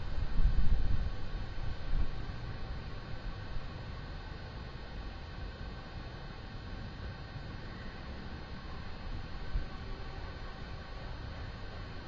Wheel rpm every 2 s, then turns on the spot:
0, 0, 0, 0, 0, 0.
none